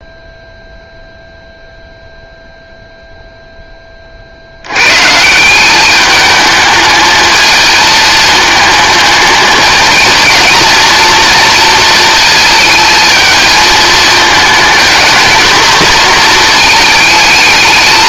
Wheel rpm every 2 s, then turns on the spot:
0, 0, 90, 220, 220, 230, 220, 220, 230.
none